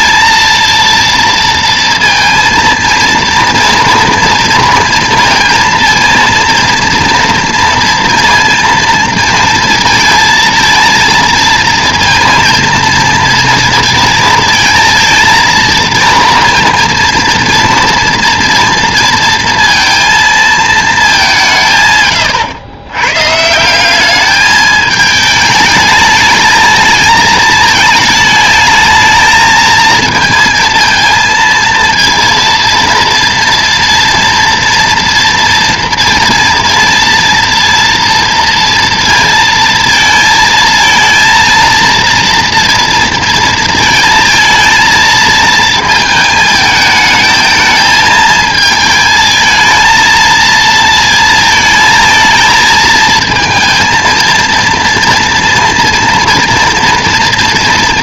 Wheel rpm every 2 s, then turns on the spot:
230, 230, 230, 230, 230, 230, 230, 230, 230, 230, 220, 110, 210, 220, 220, 230, 230, 230, 230, 230, 220, 230, 230, 220, 220, 230, 220, 230, 240.
none